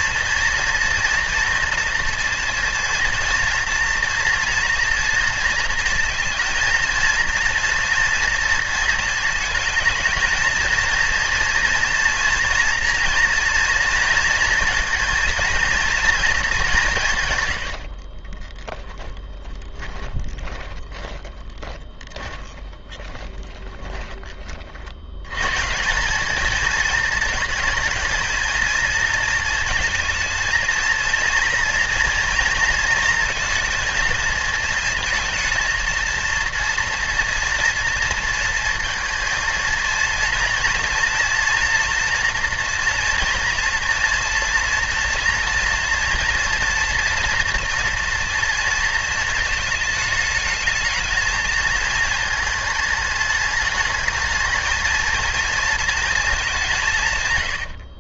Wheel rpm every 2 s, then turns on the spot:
240, 230, 230, 230, 230, 230, 230, 230, 190, 20, 20, 20, 50, 220, 230, 230, 230, 230, 230, 230, 230, 240, 230, 230, 230, 220, 210, 220, 180.
18-24